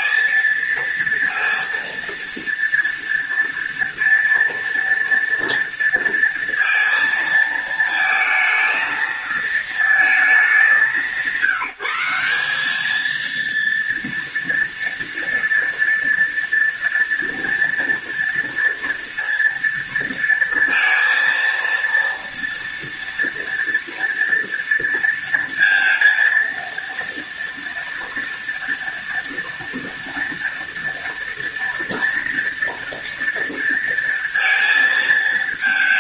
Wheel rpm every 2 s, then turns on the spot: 230, 230, 230, 230, 220, 210, 190, 230, 230, 230, 230, 230, 230, 230, 230, 230, 230, 230.
none